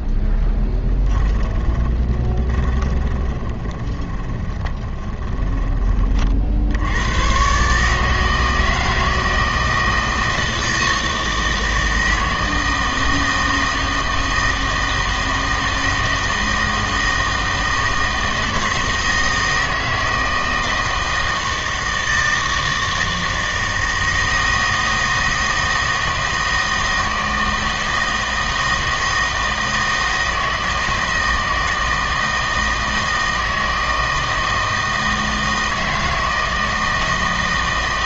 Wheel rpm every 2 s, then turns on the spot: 10, 20, 20, 60, 160, 160, 160, 160, 160, 160, 160, 160, 160, 160, 160, 160, 160, 160, 160.
0-6